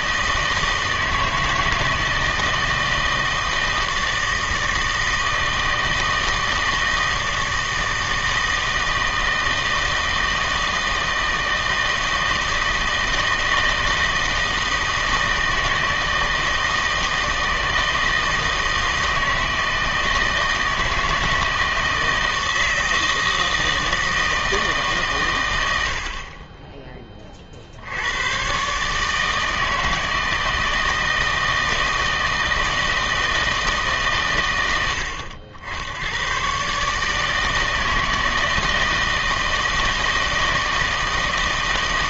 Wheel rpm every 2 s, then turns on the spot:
160, 160, 160, 160, 160, 160, 160, 160, 160, 160, 160, 160, 150, 20, 130, 160, 160, 100, 140, 160, 160.
none